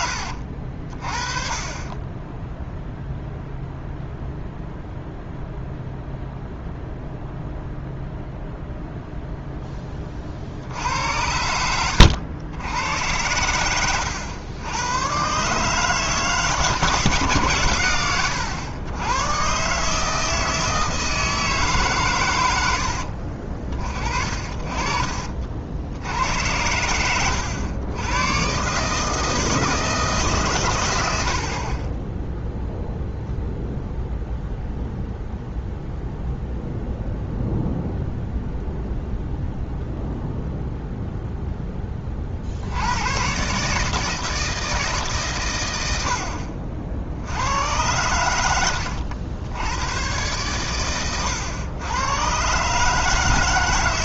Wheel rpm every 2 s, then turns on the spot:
50, 10, 0, 0, 0, 60, 90, 90, 160, 100, 160, 100, 50, 90, 140, 140, 0, 0, 0, 0, 0, 70, 160, 70, 90, 110, 140.
24-26 48-50